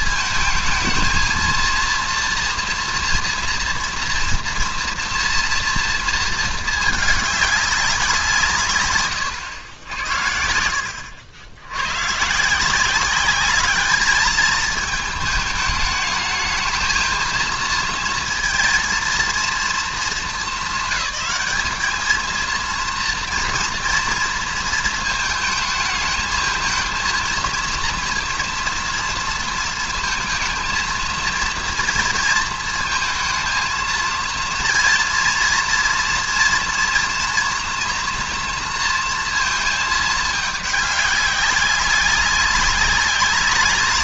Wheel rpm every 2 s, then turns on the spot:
220, 230, 230, 210, 150, 80, 180, 220, 220, 230, 200, 230, 220, 230, 230, 230, 230, 230, 230, 240, 210, 200.
none